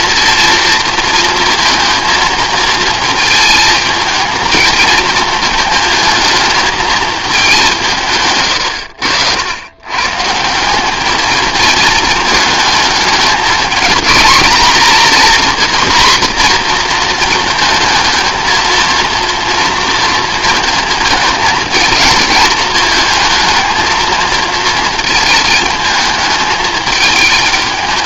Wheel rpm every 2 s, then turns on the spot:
230, 230, 220, 220, 110, 180, 220, 220, 240, 230, 230, 220, 220, 210.
none